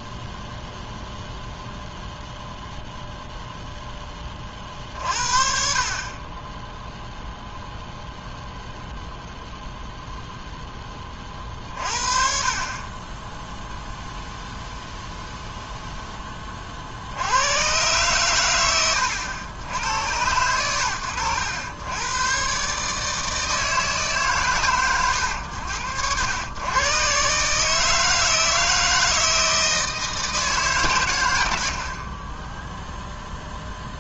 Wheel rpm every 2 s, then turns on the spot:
0, 0, 50, 0, 0, 30, 0, 0, 80, 100, 100, 160, 90, 140, 160, 80, 10.
none